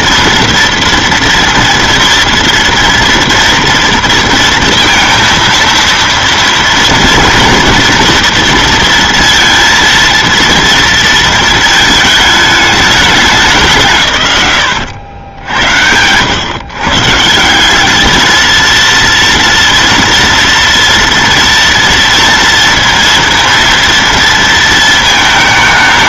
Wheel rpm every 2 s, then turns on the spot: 230, 230, 230, 230, 230, 230, 210, 100, 120, 230, 240, 230, 220.
14-16